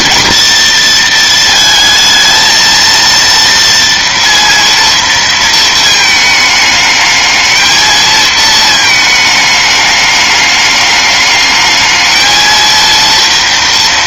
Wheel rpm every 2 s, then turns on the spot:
230, 230, 230, 220, 220, 210, 220.
none